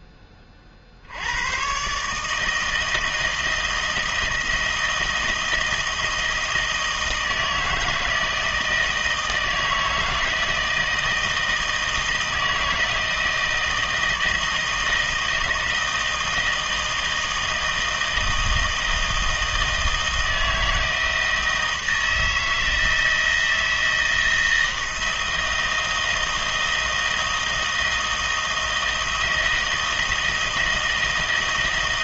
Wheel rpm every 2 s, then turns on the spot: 30, 160, 160, 160, 160, 160, 160, 160, 160, 160, 160, 160, 160, 160, 160, 160.
none